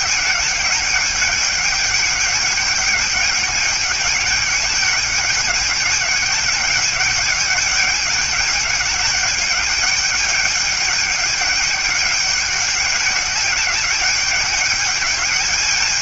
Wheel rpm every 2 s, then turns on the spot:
210, 200, 210, 210, 200, 200, 200, 210.
none